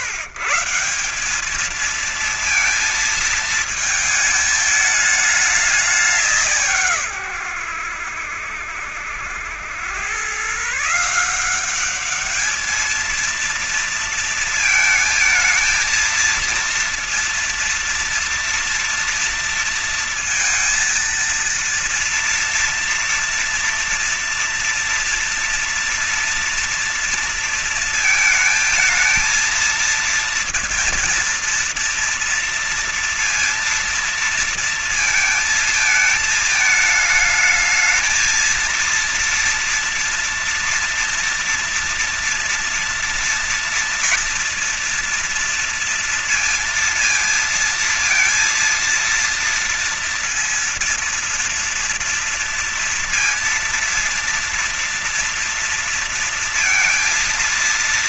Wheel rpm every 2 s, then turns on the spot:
150, 220, 220, 170, 80, 120, 200, 230, 230, 230, 230, 230, 230, 230, 220, 230, 230, 230, 220, 220, 240, 230, 230, 230, 230, 230, 230, 230, 230.
none